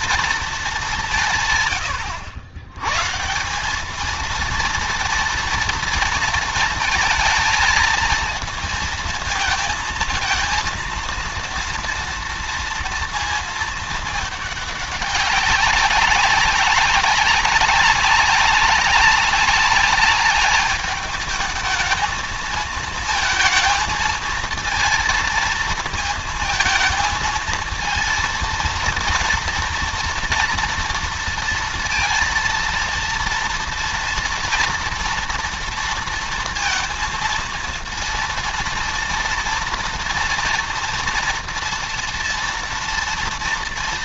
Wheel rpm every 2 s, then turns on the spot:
220, 100, 230, 230, 230, 230, 230, 210, 190, 190, 210, 220, 230, 220, 230, 230, 230, 230, 230, 230, 230, 230.
none